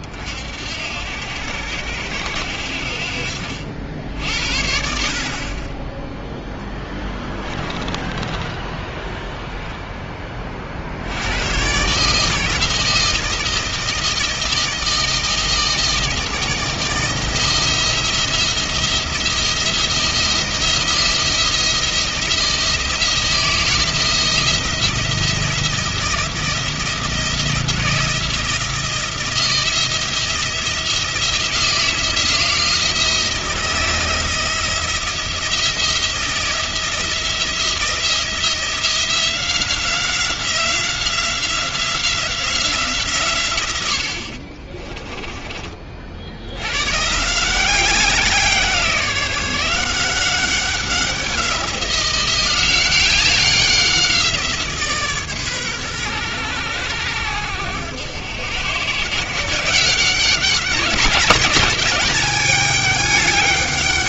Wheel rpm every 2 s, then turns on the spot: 60, 70, 70, 10, 10, 40, 160, 160, 160, 170, 170, 170, 170, 170, 170, 170, 170, 170, 170, 170, 180, 170, 40, 90, 180, 190, 180, 170, 110, 110, 200, 210.
8-10 44-46